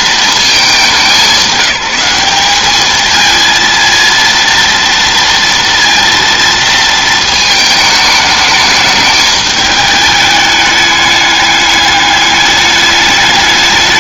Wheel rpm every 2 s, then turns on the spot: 210, 210, 230, 230, 210, 210, 210.
none